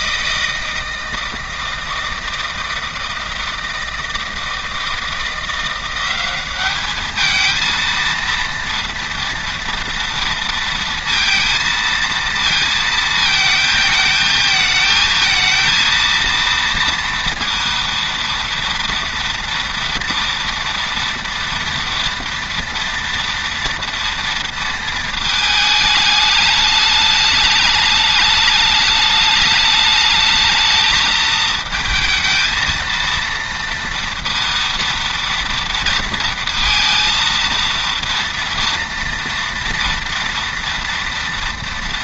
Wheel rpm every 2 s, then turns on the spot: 160, 160, 170, 220, 230, 230, 220, 220, 230, 230, 230, 230, 220, 210, 210, 220, 230, 230, 230, 230, 230.
none